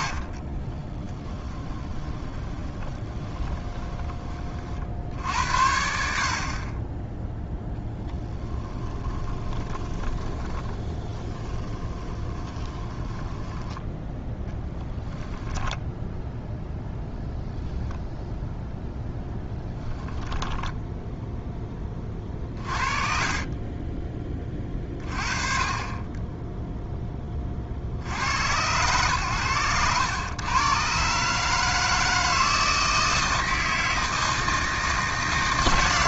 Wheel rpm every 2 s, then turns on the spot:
30, 20, 60, 20, 20, 20, 20, 10, 0, 0, 0, 40, 30, 10, 110, 130, 160, 160.
0-4 8-16